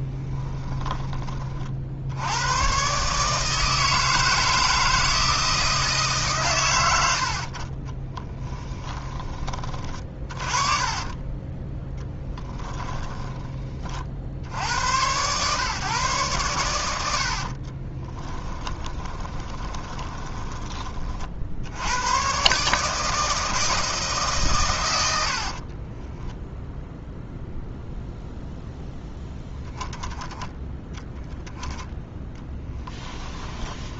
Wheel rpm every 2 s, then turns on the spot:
20, 130, 160, 80, 10, 30, 10, 100, 90, 20, 30, 150, 110, 0, 0, 0, 10.
0-2 12-14 18-20 32-34